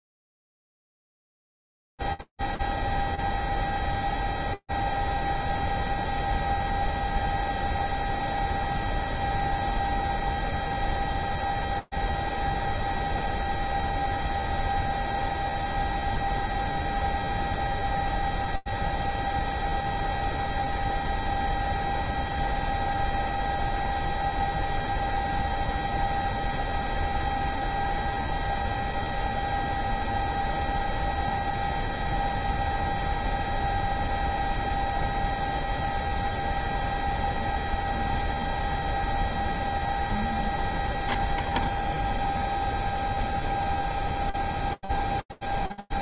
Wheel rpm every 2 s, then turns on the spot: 0, 0, 0, 0, 0, 0, 0, 0, 0, 0, 0, 0, 0, 0, 0, 0, 0, 0, 0, 0, 0, 0, 0.
none